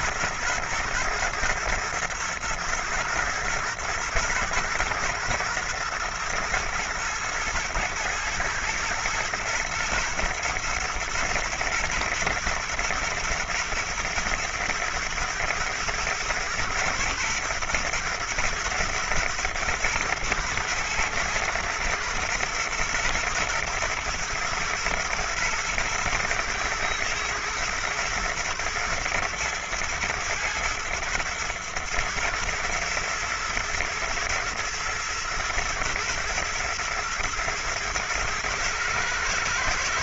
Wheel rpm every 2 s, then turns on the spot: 120, 110, 110, 120, 110, 110, 110, 110, 120, 110, 110, 120, 110, 120, 110, 110, 120, 120, 110, 110.
none